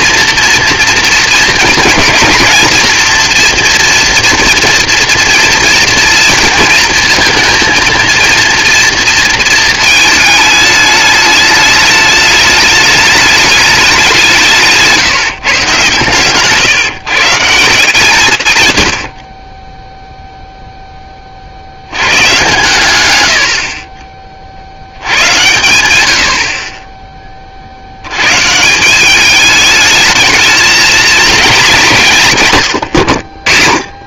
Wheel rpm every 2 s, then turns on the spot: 230, 230, 230, 230, 230, 210, 210, 150, 150, 80, 0, 110, 90, 30, 200, 230, 70.
none